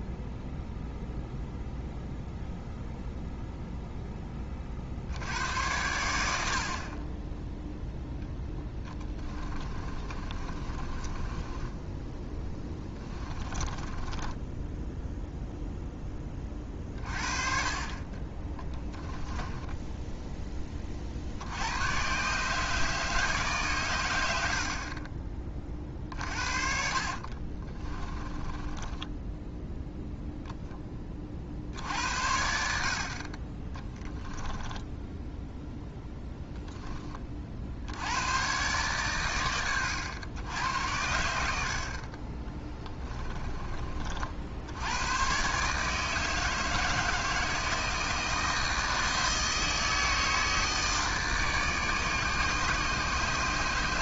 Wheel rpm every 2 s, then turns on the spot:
0, 0, 60, 40, 10, 30, 20, 0, 40, 10, 40, 150, 40, 50, 20, 20, 50, 10, 20, 130, 90, 20, 100, 160, 160, 160, 150.
6-14 18-20 24-30 34-36 42-44